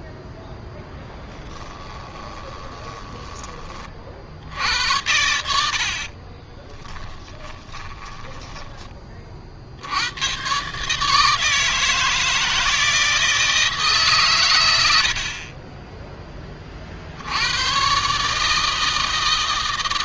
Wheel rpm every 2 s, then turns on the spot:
0, 10, 80, 30, 20, 140, 160, 90, 50, 160.
2-4 6-8